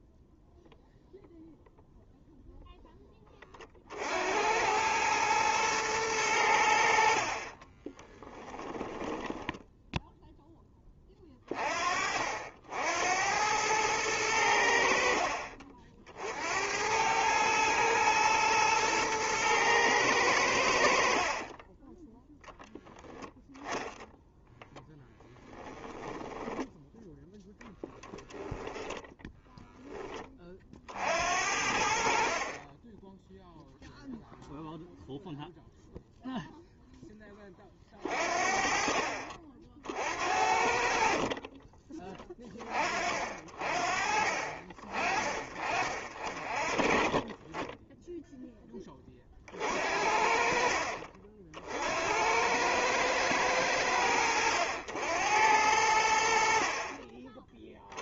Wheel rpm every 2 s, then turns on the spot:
0, 0, 90, 80, 20, 10, 70, 80, 80, 110, 80, 10, 10, 10, 10, 40, 20, 0, 0, 40, 60, 30, 40, 40, 20, 50, 100, 80, 40.
8-10 24-30